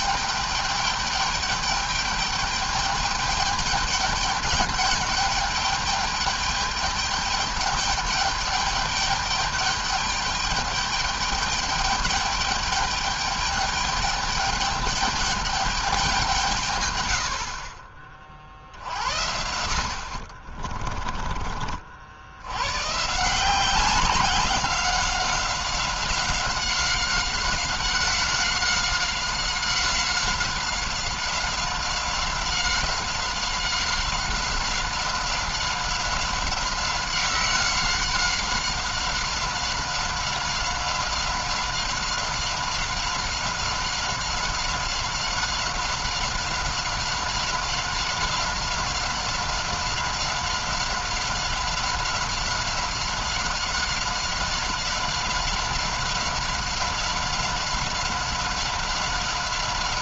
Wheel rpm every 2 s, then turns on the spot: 210, 210, 210, 210, 210, 210, 210, 210, 170, 50, 50, 90, 190, 190, 190, 190, 190, 190, 190, 190, 190, 190, 190, 190, 190, 190, 190, 190, 190, 190.
20-22